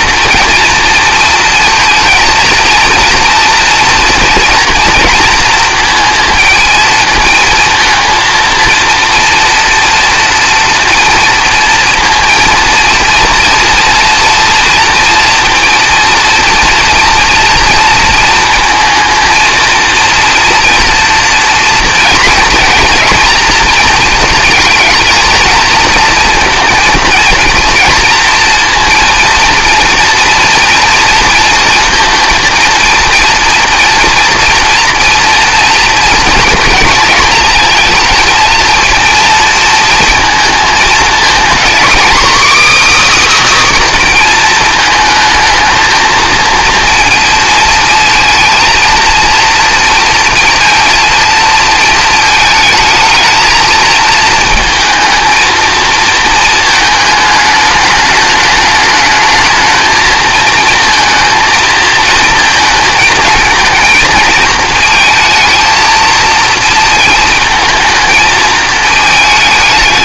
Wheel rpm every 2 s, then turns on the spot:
230, 230, 230, 230, 230, 230, 230, 230, 230, 230, 230, 230, 220, 230, 230, 230, 230, 230, 230, 230, 230, 300, 230, 230, 230, 230, 220, 220, 220, 220, 220, 220, 220, 230, 220.
none